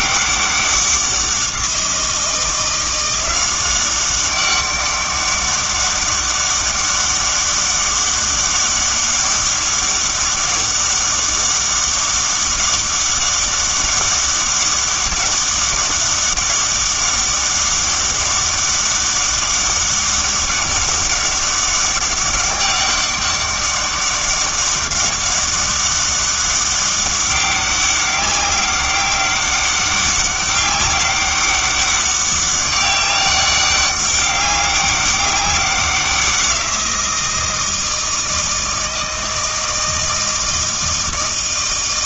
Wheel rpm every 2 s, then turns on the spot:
190, 170, 200, 200, 200, 200, 200, 200, 200, 200, 200, 200, 200, 200, 190, 200, 200, 200, 180, 160, 160.
none